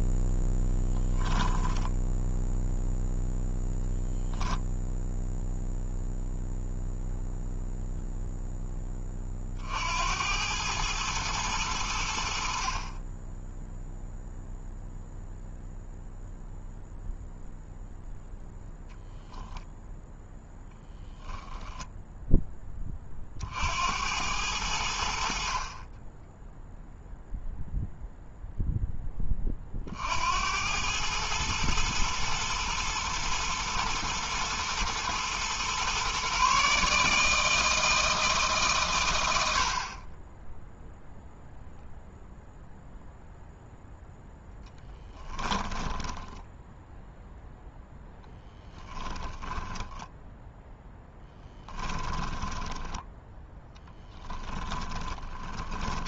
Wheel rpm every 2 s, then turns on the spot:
0, 0, 0, 0, 10, 100, 40, 0, 0, 0, 10, 20, 80, 0, 0, 100, 110, 110, 150, 130, 0, 0, 10, 0, 10, 0, 10, 20.
48-50 52-56